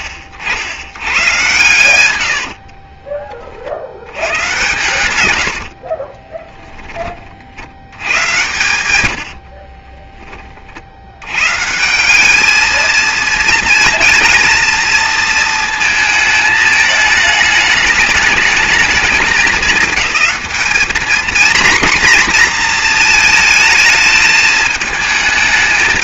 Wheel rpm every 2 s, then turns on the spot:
70, 50, 110, 10, 110, 40, 220, 230, 220, 220, 210, 230, 220.
2-4 6-8